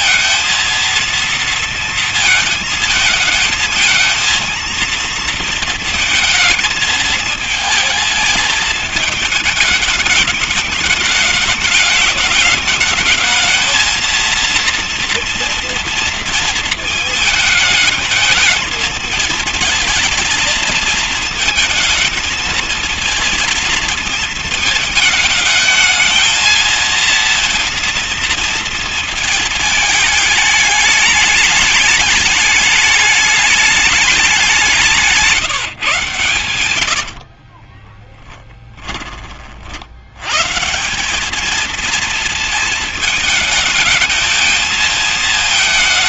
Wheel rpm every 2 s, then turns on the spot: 230, 220, 230, 230, 220, 210, 210, 230, 220, 220, 220, 220, 220, 230, 230, 210, 210, 190, 90, 10, 160, 230, 220.
36-38